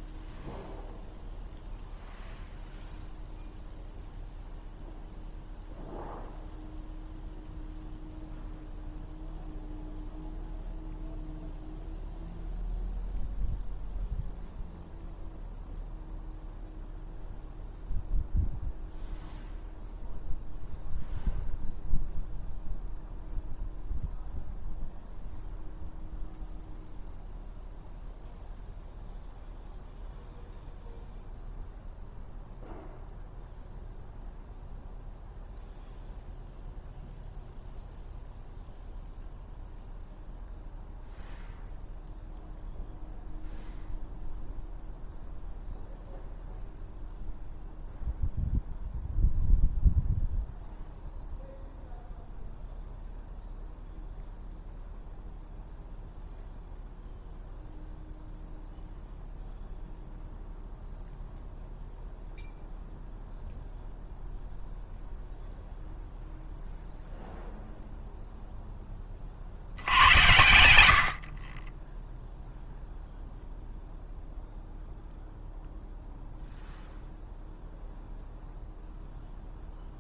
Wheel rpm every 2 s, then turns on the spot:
0, 0, 0, 0, 0, 0, 0, 0, 0, 0, 0, 0, 0, 0, 0, 0, 0, 0, 0, 0, 0, 0, 0, 0, 0, 0, 0, 0, 0, 0, 0, 0, 0, 0, 0, 110, 0, 0, 0, 0.
none